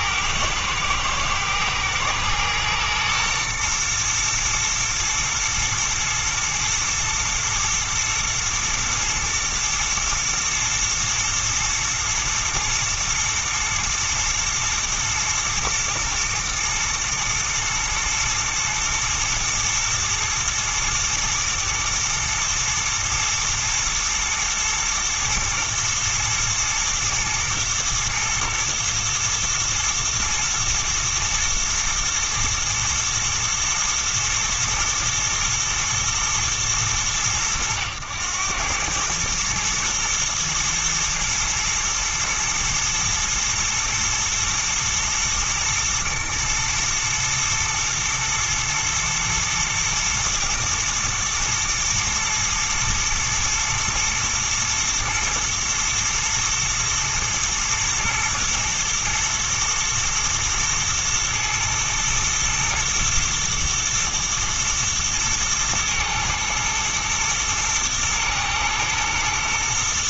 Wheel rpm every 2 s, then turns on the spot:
110, 120, 120, 110, 110, 120, 110, 120, 110, 120, 110, 110, 120, 120, 110, 120, 120, 110, 110, 100, 110, 110, 120, 120, 110, 120, 120, 120, 110, 120, 120, 120, 110, 110, 120.
none